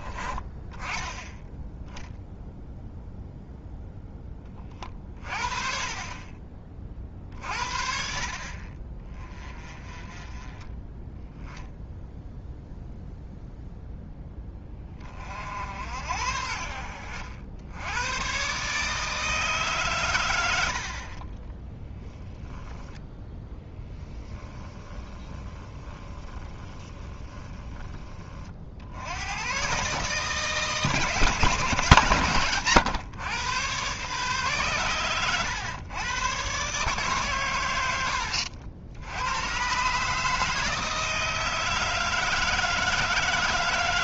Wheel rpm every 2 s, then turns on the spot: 20, 0, 30, 40, 40, 20, 0, 20, 70, 150, 60, 0, 10, 20, 60, 150, 130, 130, 130, 80, 160, 160.
24-28